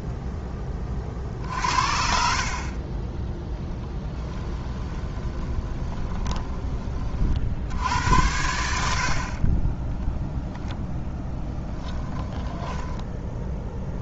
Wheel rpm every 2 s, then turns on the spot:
30, 20, 10, 20, 80, 0, 10.
4-6 12-14